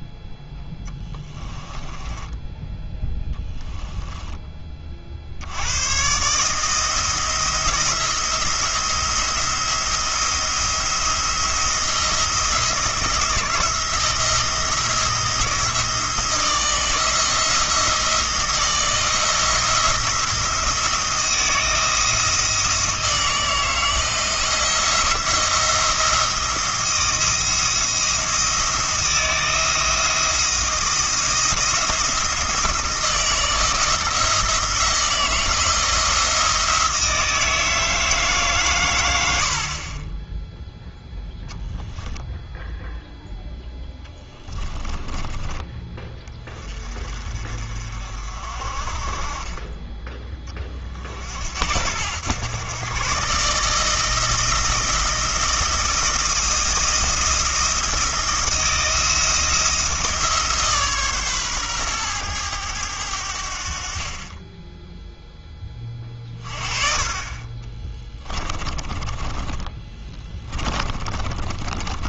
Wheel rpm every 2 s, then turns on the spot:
10, 10, 40, 160, 170, 170, 160, 170, 160, 160, 170, 160, 170, 170, 170, 170, 170, 170, 160, 110, 0, 0, 20, 40, 30, 40, 120, 160, 170, 160, 140, 90, 10, 30, 20, 30.
0-2 44-46 68-72